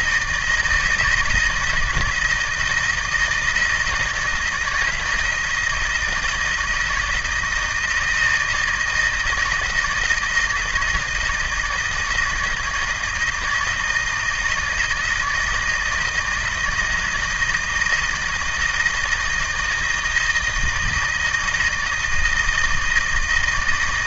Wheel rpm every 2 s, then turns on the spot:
160, 160, 170, 170, 160, 160, 160, 160, 160, 160, 160, 160.
none